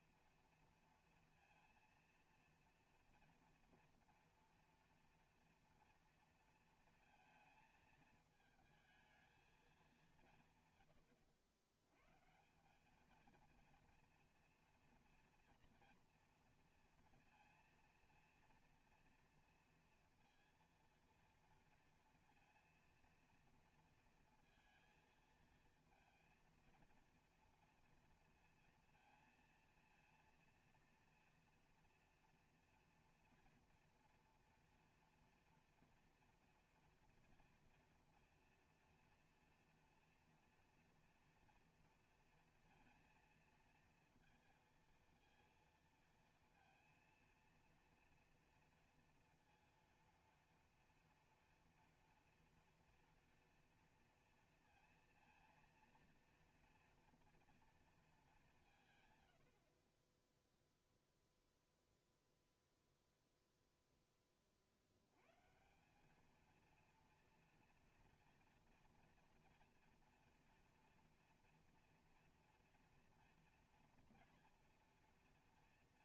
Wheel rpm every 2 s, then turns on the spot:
230, 230, 230, 230, 220, 130, 180, 230, 230, 230, 230, 230, 230, 230, 230, 230, 230, 230, 240, 230, 240, 230, 230, 230, 230, 230, 230, 230, 230, 170, 0, 0, 50, 230, 230, 230, 230, 230.
none